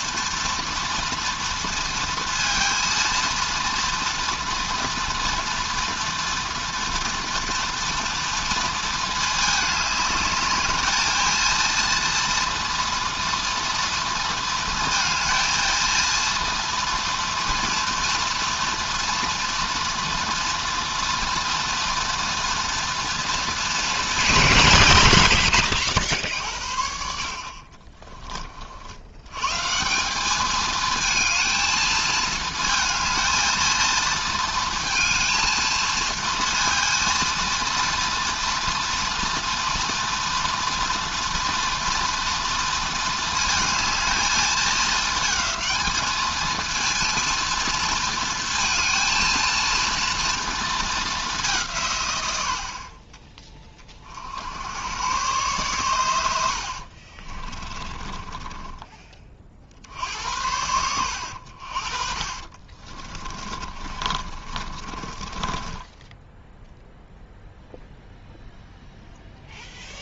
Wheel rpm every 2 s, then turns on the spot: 230, 230, 230, 230, 230, 210, 230, 230, 230, 230, 230, 230, 130, 60, 50, 220, 220, 230, 230, 230, 230, 230, 220, 220, 230, 220, 60, 90, 70, 20, 90, 30, 30, 0, 0.
56-60 62-66